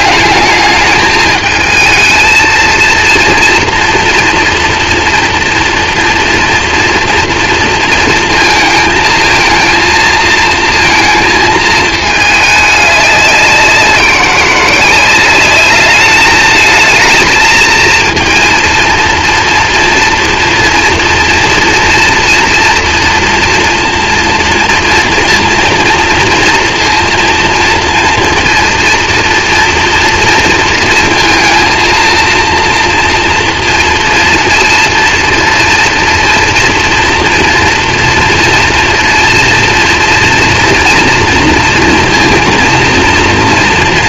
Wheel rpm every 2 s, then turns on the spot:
210, 230, 240, 230, 220, 230, 210, 180, 220, 230, 230, 230, 230, 230, 230, 230, 230, 230, 230, 230, 230, 230.
none